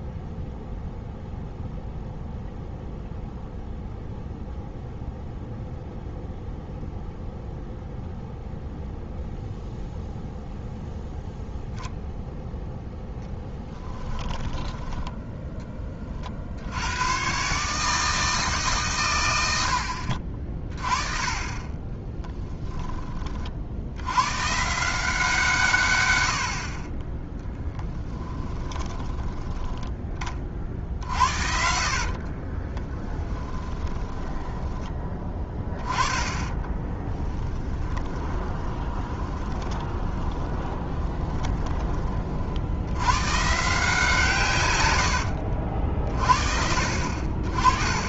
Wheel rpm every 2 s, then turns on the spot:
0, 0, 0, 0, 0, 0, 0, 20, 80, 140, 30, 10, 160, 40, 20, 50, 20, 10, 20, 20, 20, 80, 110, 60.
14-16 30-34 36-42